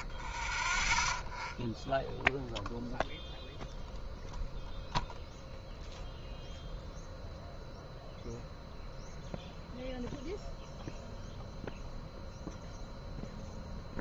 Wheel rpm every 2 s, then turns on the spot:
0, 0, 0, 0, 0, 0, 0.
none